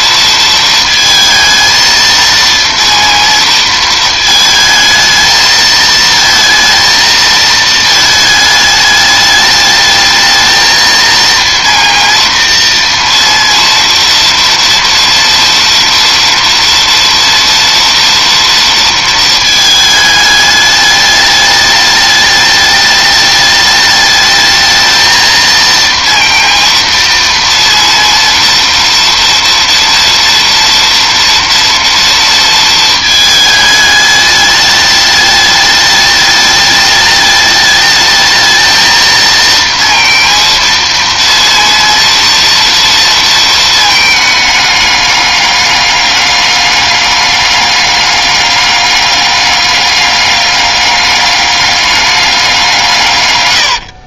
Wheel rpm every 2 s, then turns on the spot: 220, 230, 220, 230, 210, 230, 230, 230, 230, 220, 210, 210, 230, 230, 230, 230, 220, 210, 210, 230, 230, 230, 200, 200, 200, 200, 110.
52-54